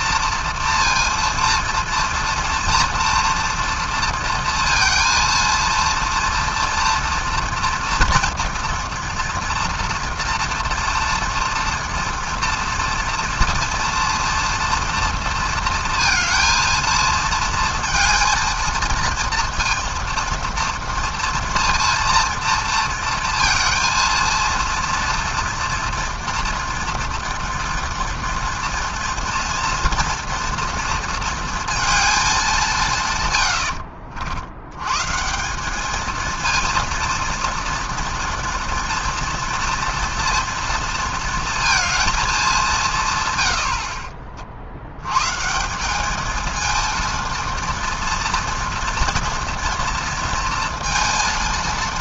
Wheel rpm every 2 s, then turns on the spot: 230, 230, 230, 240, 230, 230, 230, 230, 230, 230, 230, 230, 230, 230, 230, 230, 170, 100, 230, 240, 230, 170, 80, 230, 230, 230.
none